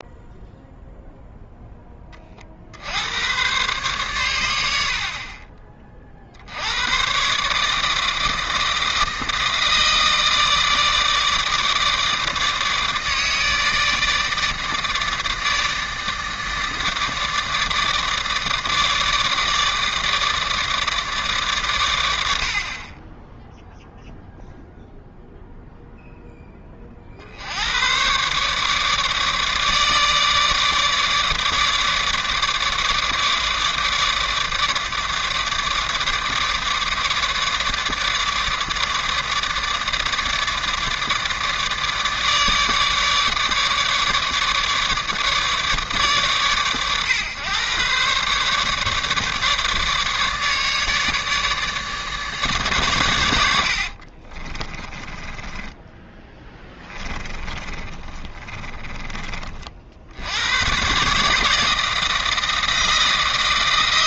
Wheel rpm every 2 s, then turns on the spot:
0, 70, 70, 90, 160, 160, 150, 160, 160, 160, 150, 30, 0, 30, 150, 150, 150, 150, 150, 150, 150, 150, 150, 110, 140, 150, 130, 20, 20, 30, 120, 160.
54-60